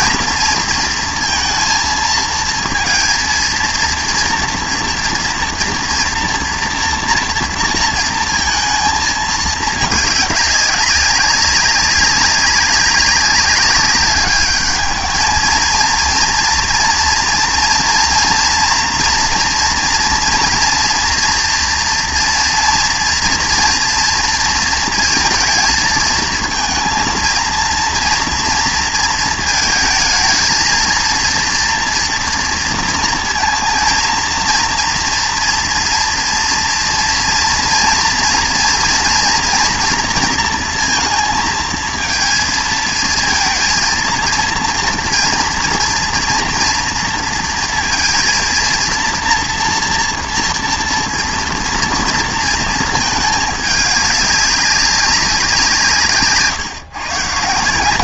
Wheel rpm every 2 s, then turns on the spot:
230, 230, 230, 230, 230, 200, 200, 210, 230, 230, 230, 230, 230, 220, 230, 220, 230, 230, 230, 230, 230, 220, 230, 230, 230, 230, 230, 200, 150.
none